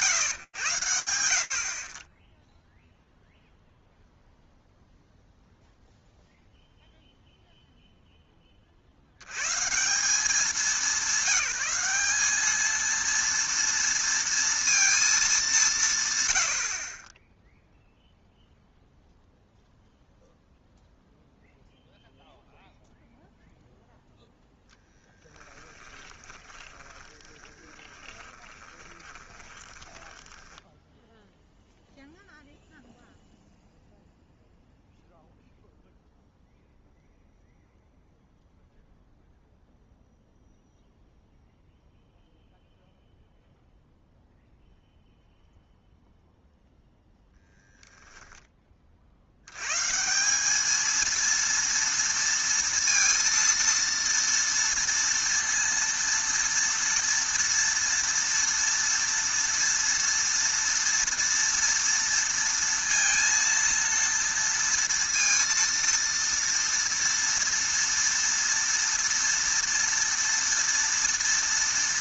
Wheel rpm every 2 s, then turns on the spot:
50, 0, 0, 30, 200, 210, 230, 90, 0, 0, 0, 0, 20, 20, 10, 0, 0, 0, 0, 0, 0, 0, 0, 0, 150, 230, 230, 230, 230, 230, 230, 230, 230, 230, 230, 230.
24-30